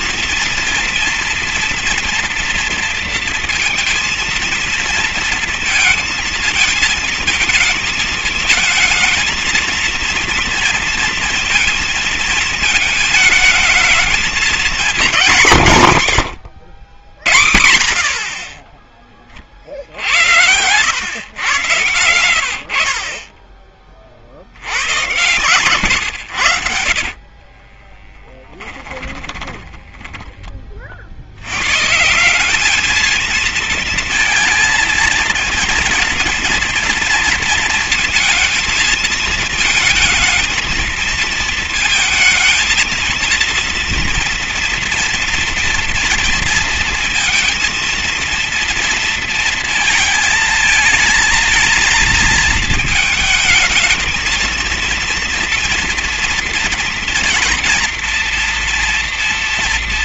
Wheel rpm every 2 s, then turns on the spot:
230, 230, 230, 220, 220, 230, 220, 230, 110, 30, 100, 70, 80, 70, 10, 40, 210, 230, 230, 230, 220, 230, 230, 230, 230, 220, 220, 230, 240, 240.
26-30